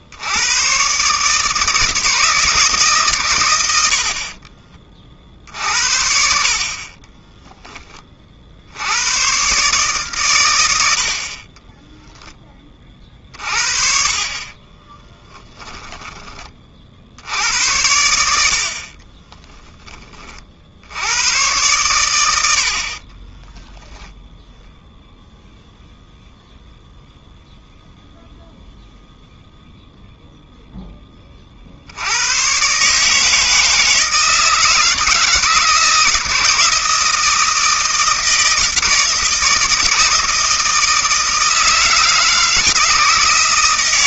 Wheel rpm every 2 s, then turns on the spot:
100, 160, 50, 50, 60, 120, 20, 40, 30, 80, 60, 70, 0, 0, 0, 0, 110, 160, 160, 160, 160, 160.
4-6 14-16